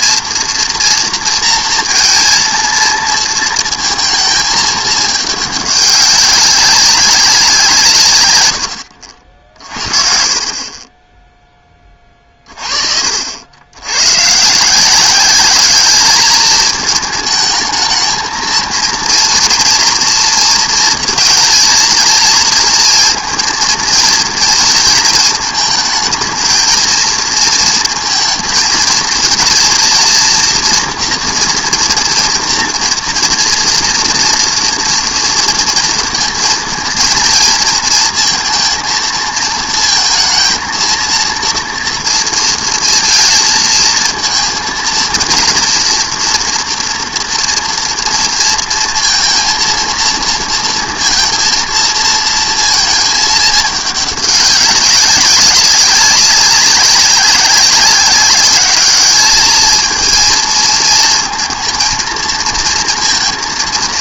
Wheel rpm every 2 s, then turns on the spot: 240, 230, 210, 200, 110, 30, 50, 160, 220, 230, 230, 220, 230, 230, 230, 230, 230, 230, 230, 230, 230, 230, 230, 230, 230, 230, 220, 200, 190, 200, 220, 230.
none